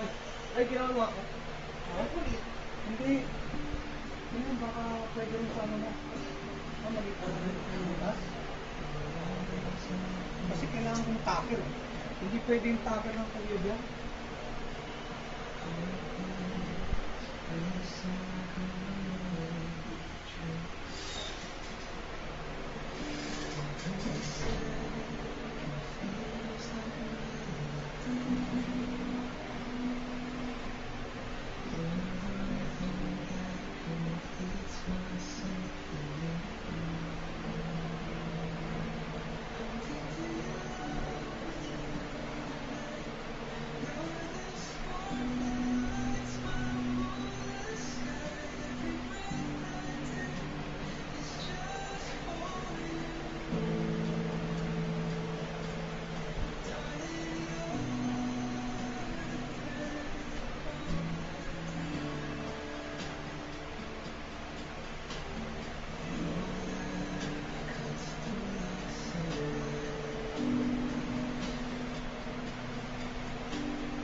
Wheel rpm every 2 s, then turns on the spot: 0, 0, 0, 0, 0, 0, 0, 0, 0, 0, 0, 0, 0, 0, 0, 0, 0, 0, 0, 0, 0, 0, 0, 0, 0, 0, 0, 0, 0, 0, 0, 0, 0, 0, 0, 0, 0.
none